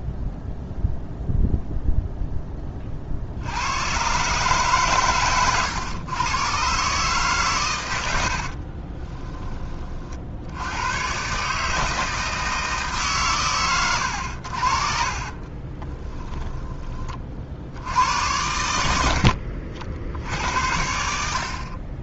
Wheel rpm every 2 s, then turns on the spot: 0, 30, 130, 130, 40, 100, 150, 50, 20, 80, 70.
8-10 14-16